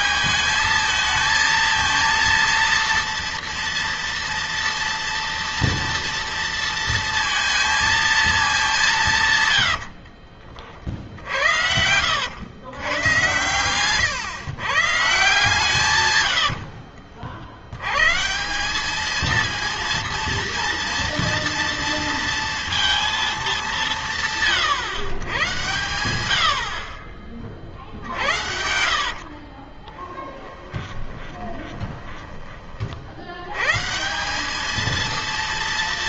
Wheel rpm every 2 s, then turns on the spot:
220, 230, 230, 230, 200, 40, 100, 130, 90, 170, 230, 230, 150, 80, 60, 20, 30, 200.
10-12 16-18 28-32